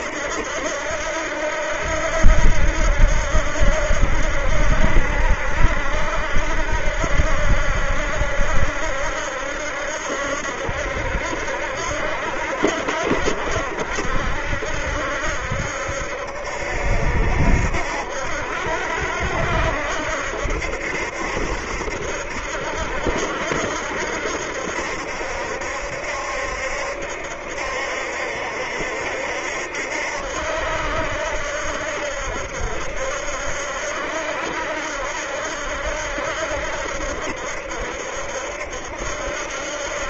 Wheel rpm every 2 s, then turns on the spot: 80, 80, 70, 80, 70, 70, 70, 70, 70, 70, 70, 80, 70, 70, 70, 70, 70, 80, 70, 70.
none